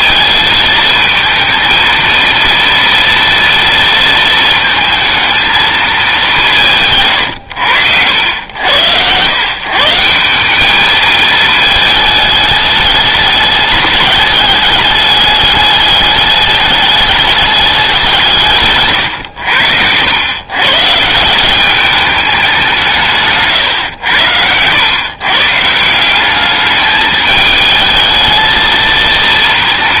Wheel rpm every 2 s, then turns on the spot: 220, 230, 220, 160, 100, 210, 210, 210, 200, 140, 140, 170, 110, 210, 230.
none